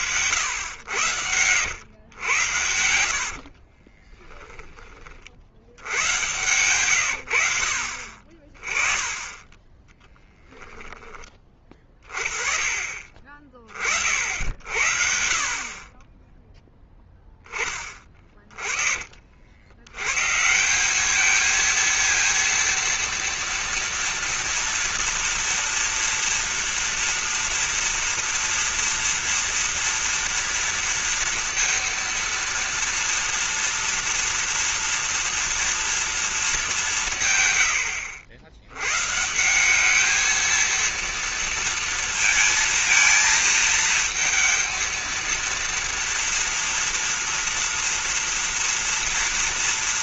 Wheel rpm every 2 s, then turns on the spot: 110, 90, 20, 110, 20, 10, 40, 50, 0, 30, 190, 230, 230, 230, 230, 230, 230, 230, 180, 110, 230, 220, 230, 230, 230.
0-2